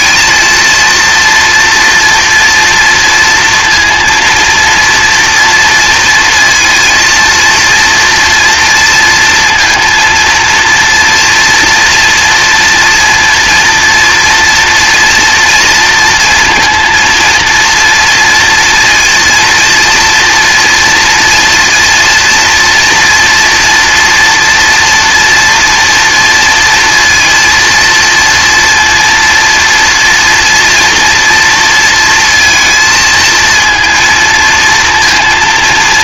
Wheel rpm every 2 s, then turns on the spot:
230, 230, 240, 230, 230, 230, 230, 230, 230, 230, 230, 230, 230, 230, 230, 230, 230, 230.
none